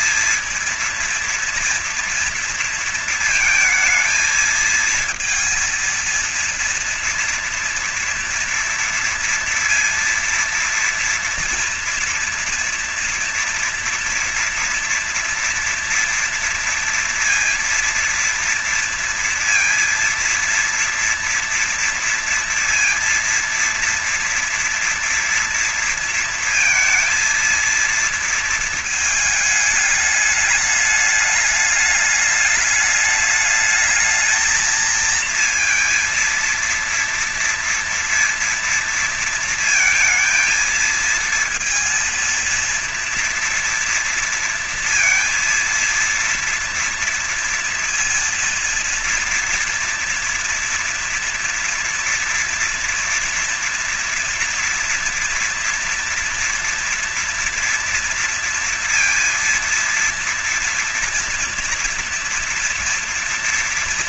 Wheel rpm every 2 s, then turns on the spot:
230, 230, 220, 230, 230, 230, 230, 230, 240, 230, 230, 230, 230, 230, 230, 210, 210, 220, 230, 230, 230, 230, 230, 230, 230, 230, 230, 230, 230, 230, 230, 230.
none